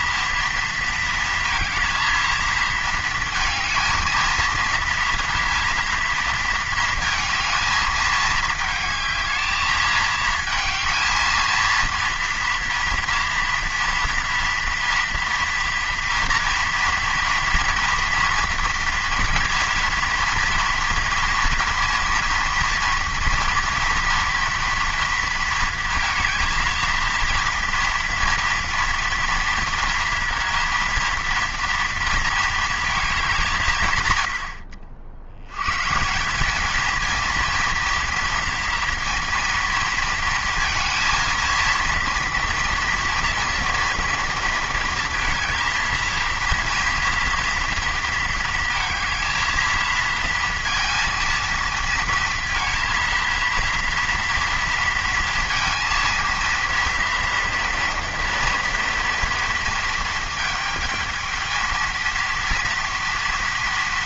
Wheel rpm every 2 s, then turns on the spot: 230, 220, 220, 220, 220, 220, 230, 230, 240, 230, 230, 230, 230, 230, 230, 230, 230, 70, 210, 230, 230, 230, 230, 230, 230, 230, 230, 230, 230, 230, 220, 230.
none